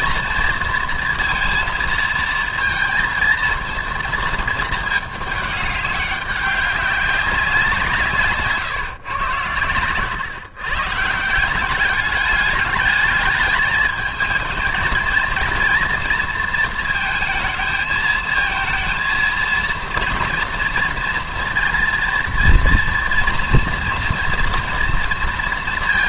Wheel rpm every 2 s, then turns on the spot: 230, 220, 220, 200, 130, 140, 210, 230, 220, 230, 230, 230, 230.
none